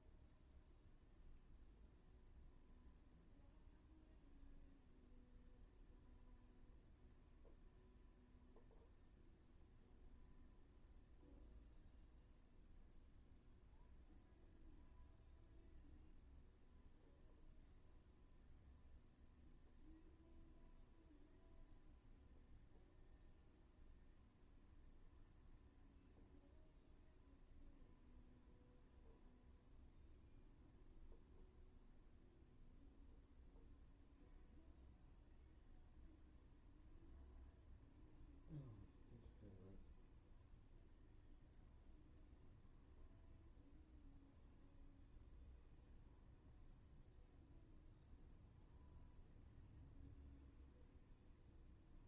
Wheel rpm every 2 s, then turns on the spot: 0, 0, 0, 0, 0, 0, 0, 0, 0, 0, 0, 0, 0, 0, 0, 0, 0, 0, 0, 0, 0, 0, 0, 0, 0, 0.
none